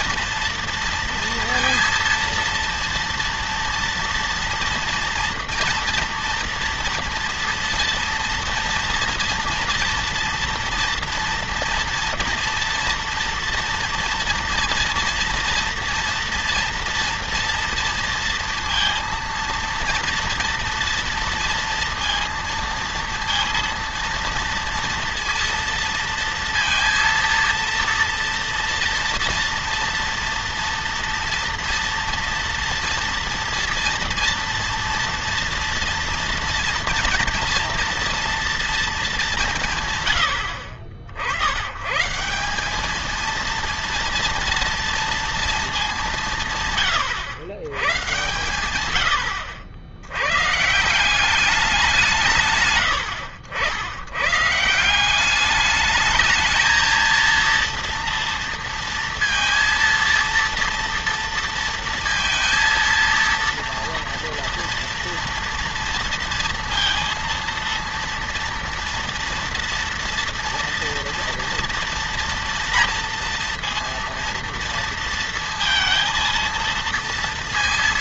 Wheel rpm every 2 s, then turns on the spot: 230, 230, 240, 240, 230, 240, 230, 230, 230, 230, 230, 230, 230, 230, 230, 230, 230, 230, 230, 230, 120, 160, 230, 180, 120, 110, 170, 110, 220, 230, 230, 230, 230, 230, 230, 230, 230, 230, 230.
none